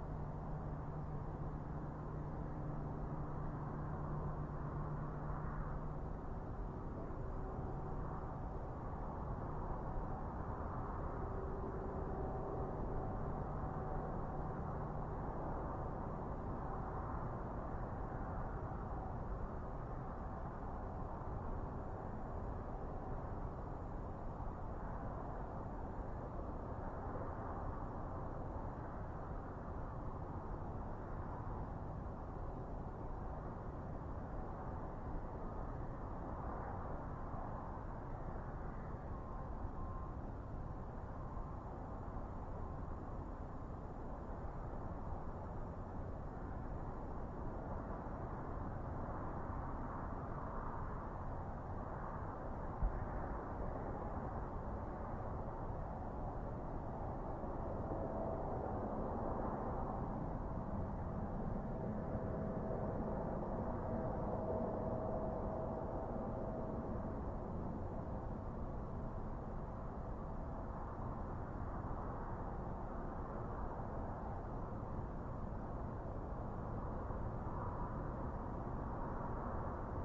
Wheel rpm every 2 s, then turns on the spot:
0, 0, 0, 0, 0, 0, 0, 0, 0, 0, 0, 0, 0, 0, 0, 0, 0, 0, 0, 0, 0, 0, 0, 0, 0, 0, 0, 0, 0, 0, 0, 0, 0, 0, 0, 0, 0, 0, 0, 0.
none